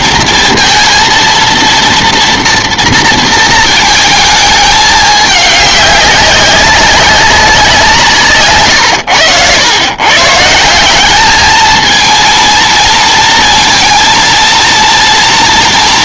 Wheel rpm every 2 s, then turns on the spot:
230, 230, 210, 190, 120, 180, 230, 230.
none